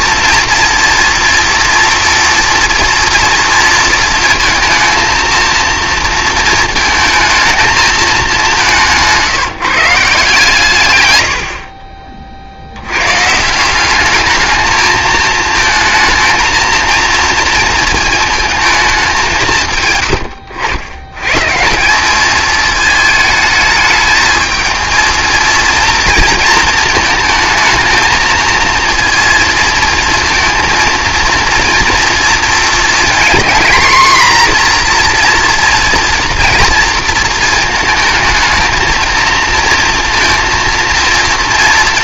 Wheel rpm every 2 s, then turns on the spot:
230, 230, 230, 230, 180, 130, 90, 220, 230, 210, 90, 220, 220, 220, 230, 230, 230, 240, 230, 230, 230.
8-10